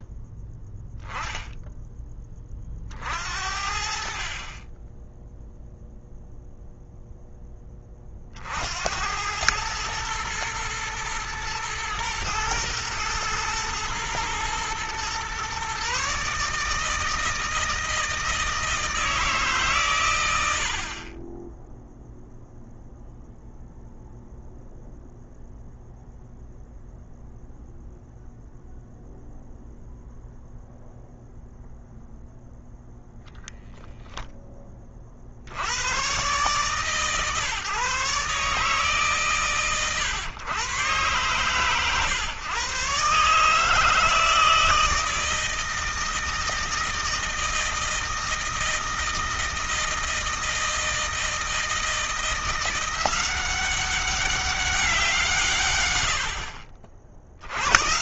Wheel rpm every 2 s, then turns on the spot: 0, 40, 10, 0, 70, 110, 110, 120, 150, 160, 60, 0, 0, 0, 0, 0, 0, 20, 140, 150, 120, 130, 160, 160, 160, 160, 170, 190, 80.
none